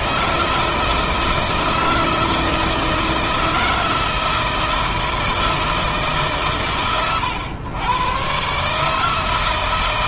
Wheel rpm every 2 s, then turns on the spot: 160, 160, 160, 140, 140.
none